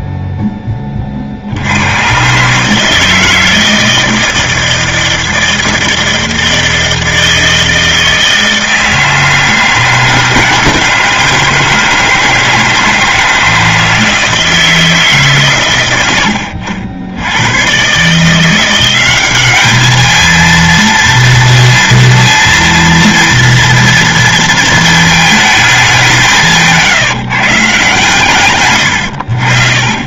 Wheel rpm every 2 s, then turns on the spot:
30, 150, 160, 160, 160, 160, 160, 160, 70, 180, 230, 230, 230, 150, 90.
none